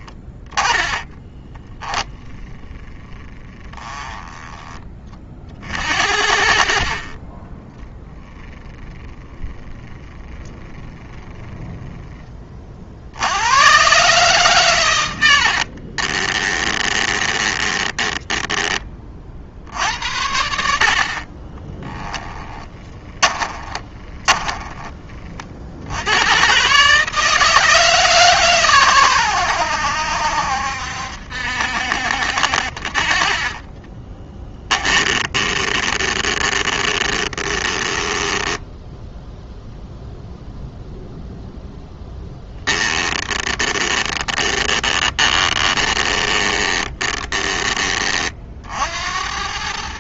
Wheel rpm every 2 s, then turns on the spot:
10, 10, 30, 30, 10, 10, 60, 110, 20, 30, 50, 20, 20, 150, 110, 70, 50, 20, 20, 0, 0, 10, 20, 20, 70.
6-8 16-18 22-24 34-38 42-48